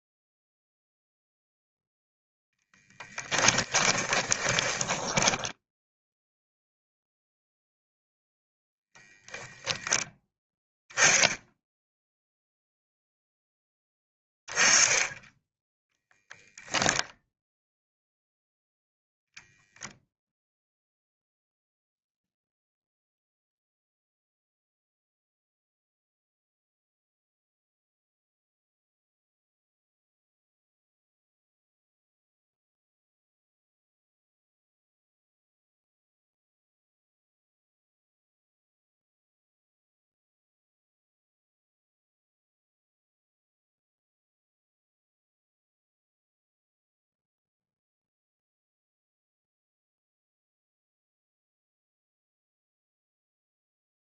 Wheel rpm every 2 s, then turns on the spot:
0, 10, 10, 0, 0, 0, 0, 10, 10, 0, 0, 0, 0, 0, 0, 0, 0, 0, 0, 0, 0, 0, 0, 0, 0, 0, 0.
2-6